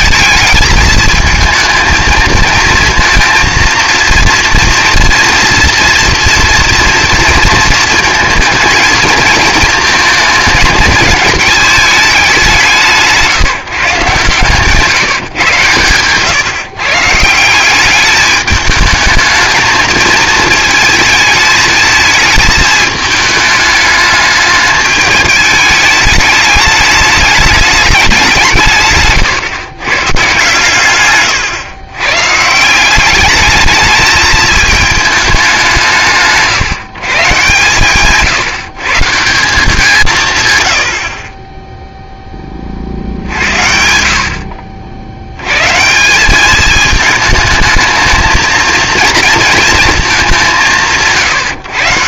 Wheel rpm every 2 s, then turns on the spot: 220, 230, 230, 230, 220, 220, 180, 170, 140, 210, 220, 220, 210, 210, 150, 140, 170, 220, 150, 150, 70, 30, 60, 210, 220, 170.
none